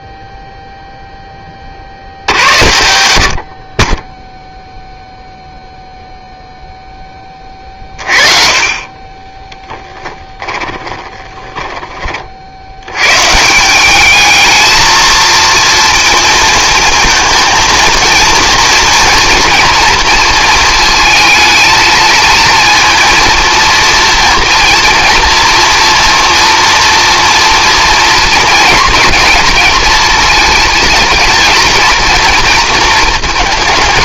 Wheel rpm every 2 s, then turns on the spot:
0, 70, 10, 0, 30, 10, 110, 220, 230, 230, 220, 230, 230, 230, 230, 230, 230.
10-12